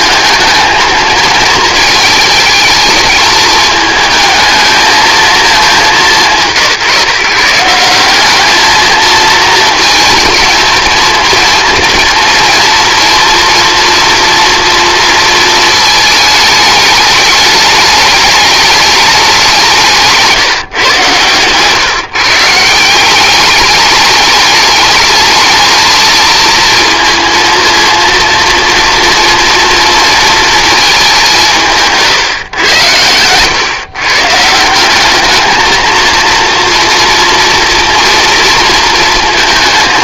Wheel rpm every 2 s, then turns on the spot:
220, 220, 220, 170, 210, 230, 230, 230, 220, 210, 160, 150, 210, 220, 230, 230, 120, 150, 230, 230.
none